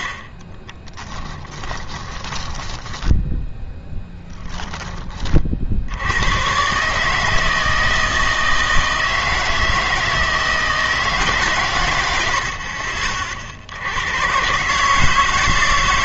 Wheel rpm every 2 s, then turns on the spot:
20, 10, 10, 140, 160, 160, 60, 140.
0-4 12-14